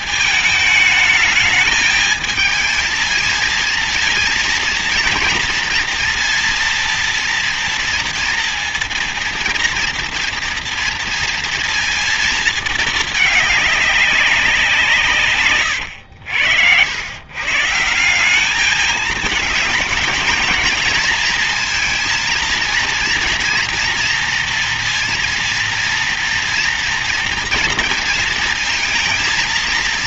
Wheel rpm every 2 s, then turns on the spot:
220, 220, 230, 240, 230, 230, 230, 180, 80, 200, 230, 230, 230, 230, 230.
none